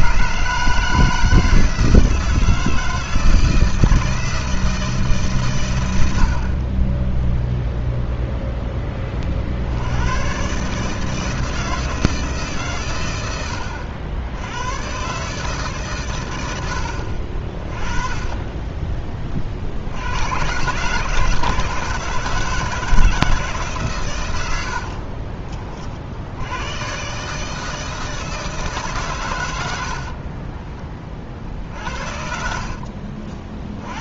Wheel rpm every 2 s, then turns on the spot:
160, 160, 160, 10, 20, 150, 120, 130, 70, 20, 140, 160, 50, 130, 140, 30, 40.
24-26